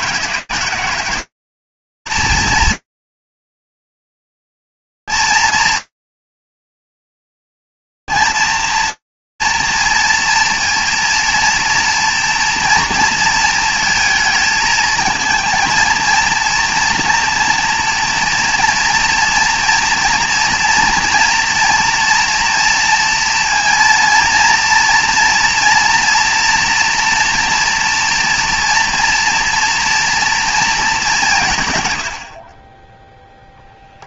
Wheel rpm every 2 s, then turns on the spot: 180, 230, 230, 230, 230, 230, 230, 230, 230, 230, 230, 230, 230, 230, 240, 230, 90.
none